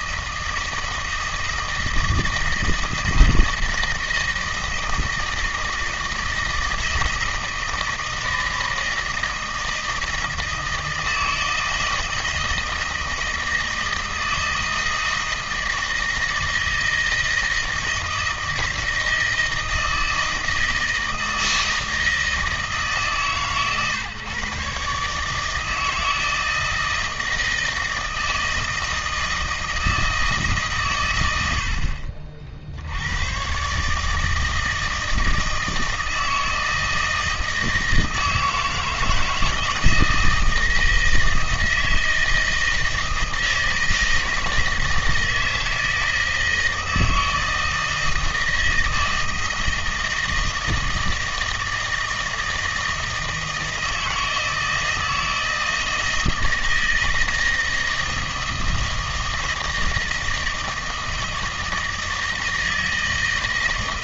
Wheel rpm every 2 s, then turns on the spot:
160, 160, 160, 160, 160, 160, 160, 160, 160, 160, 160, 160, 140, 160, 160, 140, 70, 160, 160, 160, 160, 160, 160, 160, 160, 160, 160, 160, 160, 160, 160, 160.
none